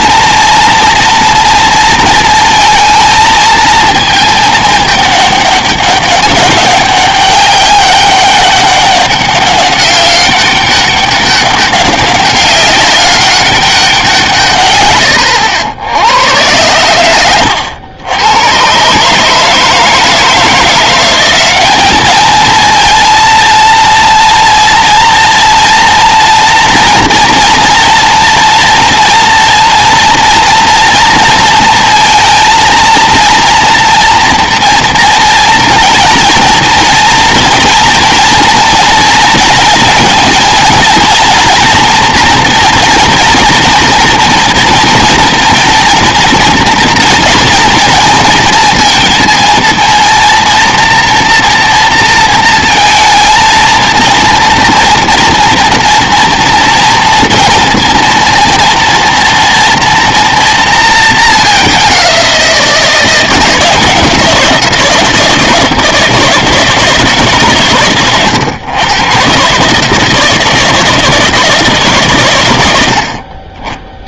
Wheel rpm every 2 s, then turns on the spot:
230, 230, 210, 200, 200, 200, 200, 150, 100, 110, 170, 220, 230, 230, 230, 230, 230, 230, 230, 240, 230, 230, 230, 230, 230, 230, 230, 220, 230, 230, 230, 180, 170, 160, 120, 160, 110.
none